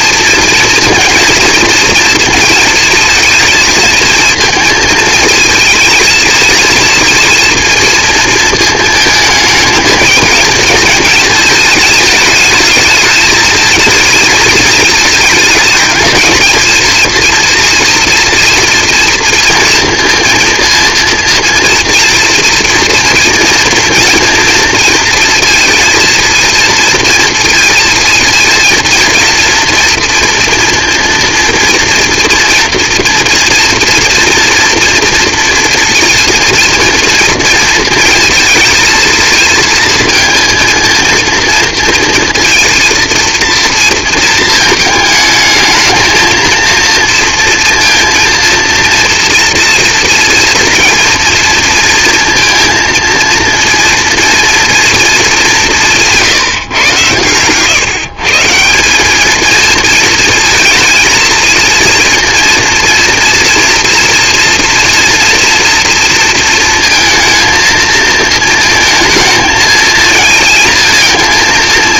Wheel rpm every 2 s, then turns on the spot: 230, 230, 220, 230, 220, 220, 210, 220, 220, 230, 230, 230, 230, 230, 230, 230, 230, 230, 230, 230, 230, 230, 220, 230, 230, 230, 230, 230, 150, 150, 230, 230, 230, 230, 230, 230.
56-58